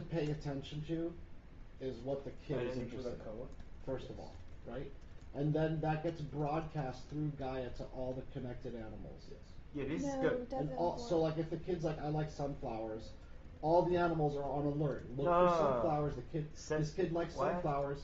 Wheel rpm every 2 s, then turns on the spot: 0, 0, 0, 0, 0, 0, 0, 0, 0.
none